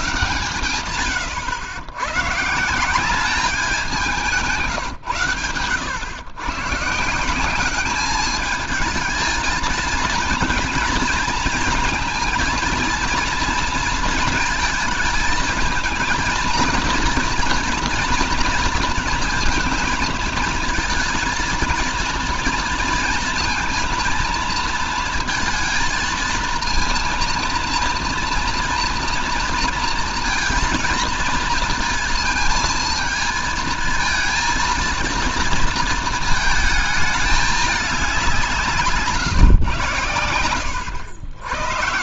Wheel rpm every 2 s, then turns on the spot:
110, 170, 150, 150, 220, 230, 230, 220, 230, 230, 230, 230, 230, 230, 230, 230, 230, 230, 220, 160, 80.
none